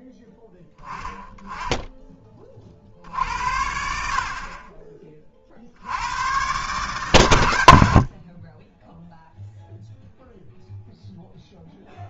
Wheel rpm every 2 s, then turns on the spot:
10, 40, 30, 130, 10, 0.
none